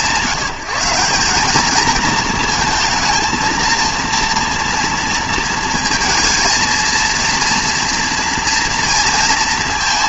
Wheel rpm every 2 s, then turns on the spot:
170, 230, 230, 230, 230.
none